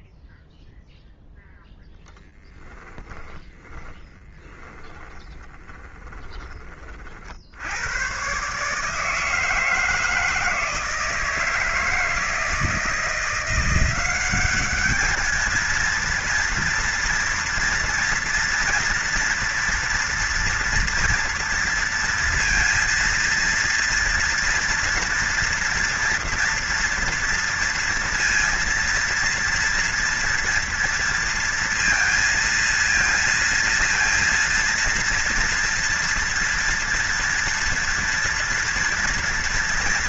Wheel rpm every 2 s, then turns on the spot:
0, 10, 20, 20, 130, 160, 160, 200, 230, 230, 230, 230, 230, 230, 230, 240, 230, 230, 240, 240.
2-6